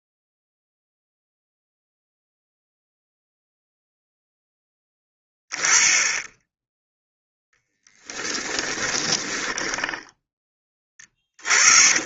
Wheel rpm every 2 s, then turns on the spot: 0, 0, 10, 0, 20, 20.
8-12